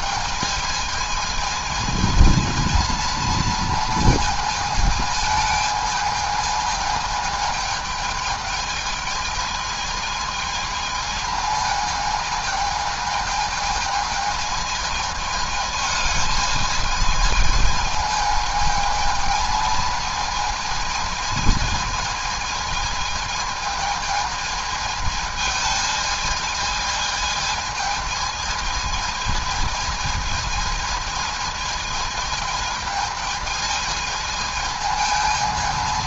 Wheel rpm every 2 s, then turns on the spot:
220, 230, 220, 220, 220, 220, 220, 220, 220, 220, 220, 220, 220, 220, 220, 220, 220, 220.
none